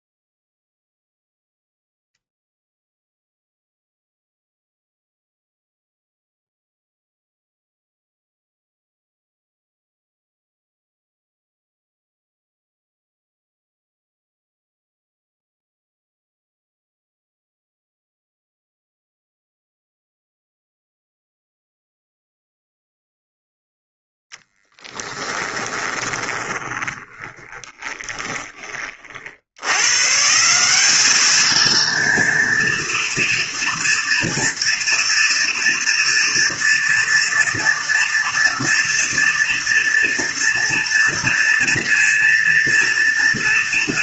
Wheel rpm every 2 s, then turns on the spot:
0, 0, 0, 0, 0, 0, 0, 0, 0, 0, 0, 0, 10, 20, 30, 190, 230, 230, 240, 230, 230, 230.
24-28